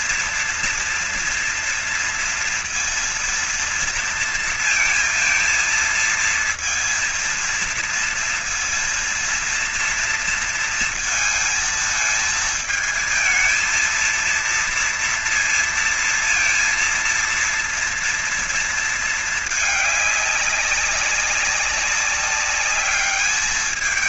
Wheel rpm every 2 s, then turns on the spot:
230, 230, 230, 230, 230, 230, 220, 230, 230, 220, 200, 200.
none